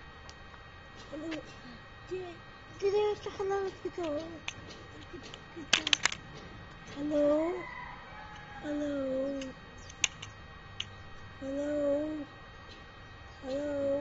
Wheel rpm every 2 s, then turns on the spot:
0, 0, 0, 0, 0, 0, 0.
none